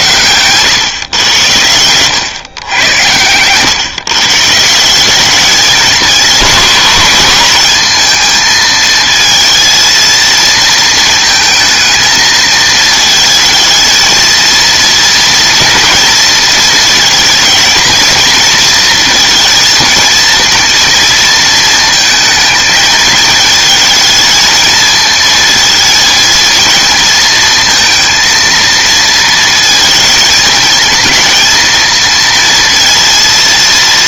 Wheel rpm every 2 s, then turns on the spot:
110, 120, 150, 220, 220, 220, 220, 230, 220, 230, 230, 220, 220, 230, 230, 220, 230.
0-2